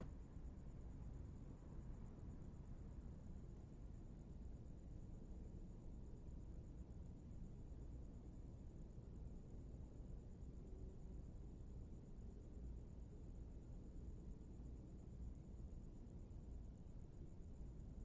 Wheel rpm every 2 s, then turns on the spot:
0, 0, 0, 0, 0, 0, 0, 0, 0.
none